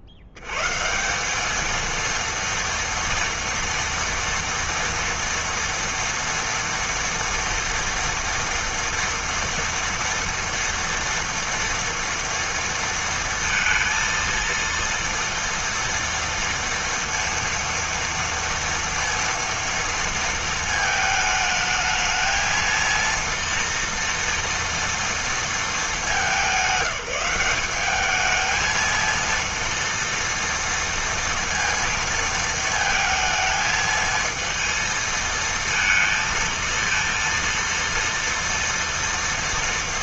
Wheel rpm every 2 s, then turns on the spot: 70, 230, 230, 230, 230, 230, 230, 230, 230, 230, 220, 230, 240, 190, 220, 230, 230, 220, 230, 230.
none